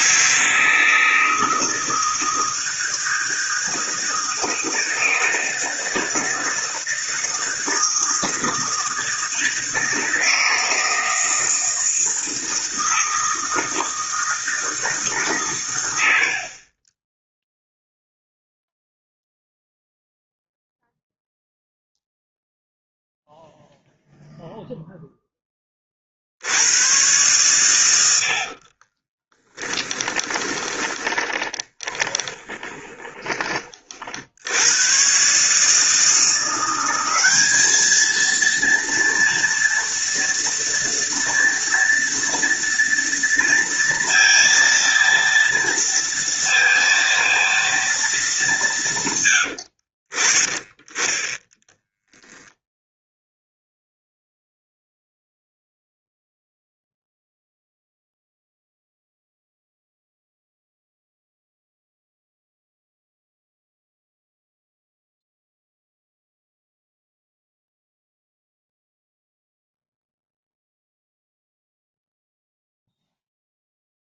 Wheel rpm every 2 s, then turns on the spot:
160, 160, 160, 160, 160, 160, 160, 160, 20, 0, 0, 0, 0, 100, 40, 20, 20, 110, 180, 230, 230, 230, 230, 230, 160, 20, 0, 0, 0, 0, 0, 0, 0, 0, 0, 0, 0.
28-34